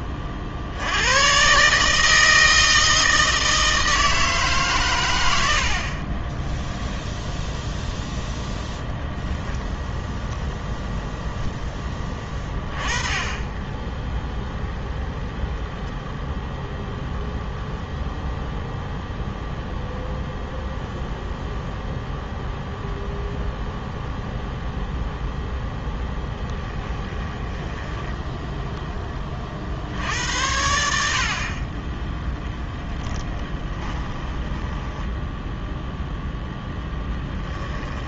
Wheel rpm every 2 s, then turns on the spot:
60, 160, 150, 10, 0, 0, 20, 0, 0, 0, 0, 0, 0, 10, 10, 80, 10, 10, 10.
6-8 32-36